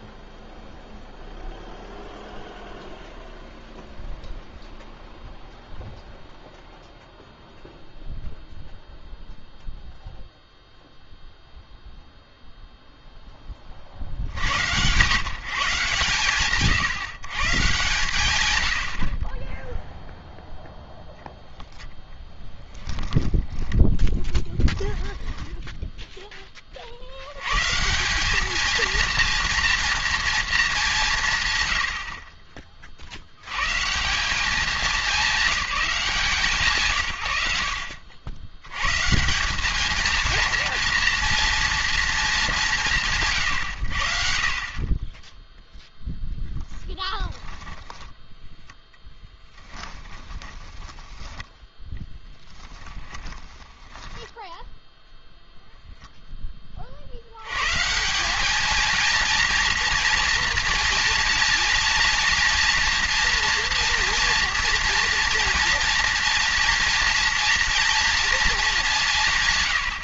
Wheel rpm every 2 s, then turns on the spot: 0, 0, 0, 0, 0, 0, 0, 80, 130, 90, 0, 10, 10, 50, 220, 230, 50, 200, 130, 110, 230, 180, 50, 10, 10, 20, 10, 0, 30, 210, 230, 230, 230, 230, 220.
22-26 46-48 50-54